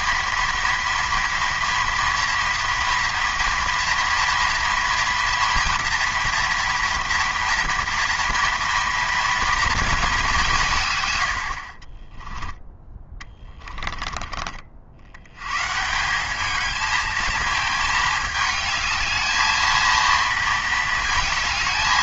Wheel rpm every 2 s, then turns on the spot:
230, 230, 230, 230, 230, 100, 20, 90, 220, 220, 220.
12-14